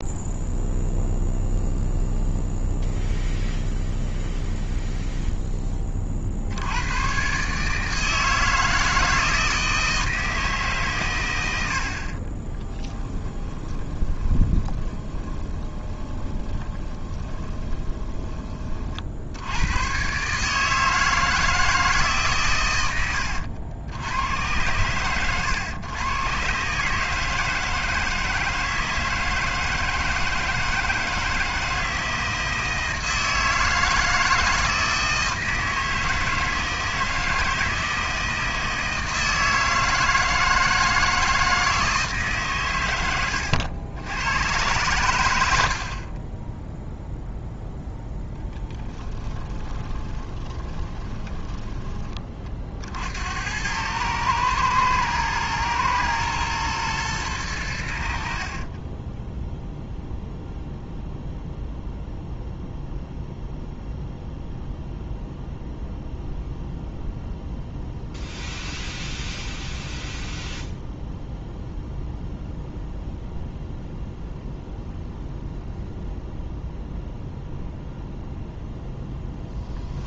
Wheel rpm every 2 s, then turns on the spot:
0, 0, 0, 120, 160, 120, 10, 20, 20, 60, 160, 100, 110, 160, 160, 160, 160, 160, 160, 160, 160, 100, 100, 0, 10, 10, 70, 120, 110, 20, 0, 0, 0, 0, 0, 0, 0, 0, 0, 0.
12-18 48-52 58-60